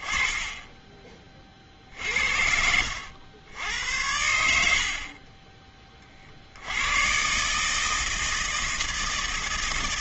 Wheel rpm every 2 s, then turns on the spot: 10, 70, 70, 100, 160.
none